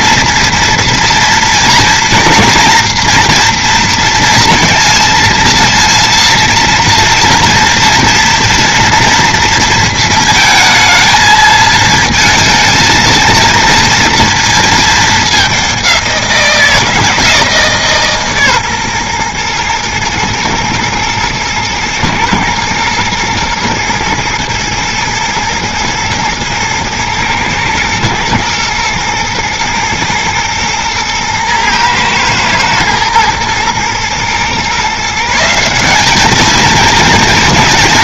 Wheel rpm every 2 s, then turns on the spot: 230, 230, 230, 230, 230, 220, 230, 220, 170, 140, 120, 120, 110, 110, 120, 110, 110, 130, 220.
none